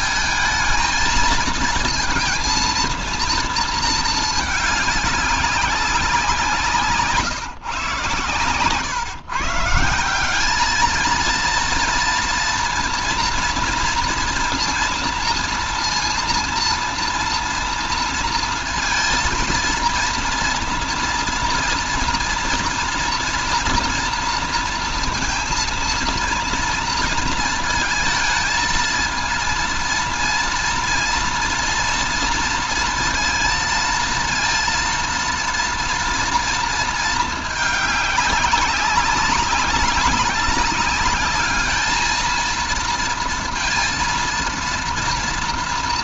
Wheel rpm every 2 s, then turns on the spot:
220, 230, 210, 160, 120, 210, 230, 230, 230, 230, 230, 230, 230, 230, 230, 230, 230, 230, 230, 200, 200, 230, 230.
none